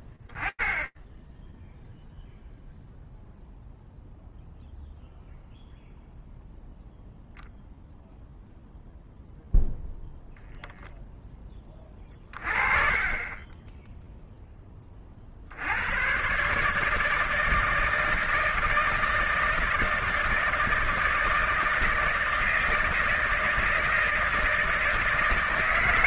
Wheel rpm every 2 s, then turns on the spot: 0, 0, 0, 0, 0, 30, 40, 160, 160, 160, 160, 160, 160.
none